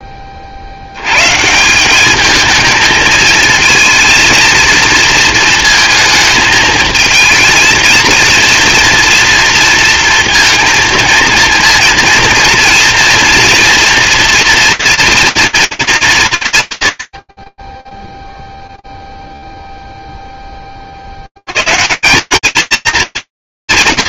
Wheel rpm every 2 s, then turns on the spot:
80, 220, 230, 220, 230, 230, 230, 230, 80, 0, 20, 220.
none